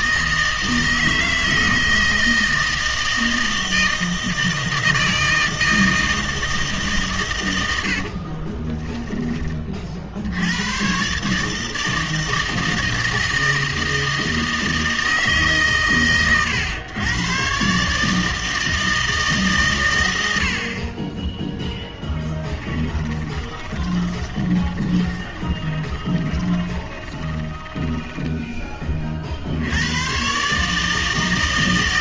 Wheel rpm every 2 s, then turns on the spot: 160, 160, 160, 160, 30, 100, 160, 160, 110, 160, 60, 20, 20, 20, 20, 140.
8-10 22-28